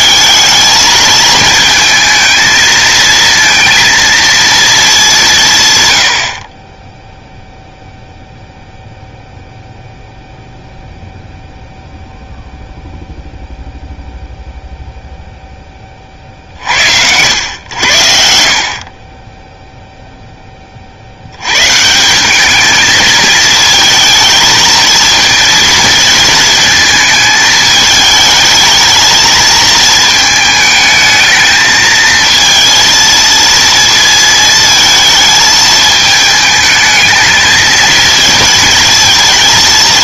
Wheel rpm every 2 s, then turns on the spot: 220, 220, 220, 20, 0, 0, 0, 0, 60, 50, 30, 210, 220, 220, 220, 220, 230, 230, 210, 220.
none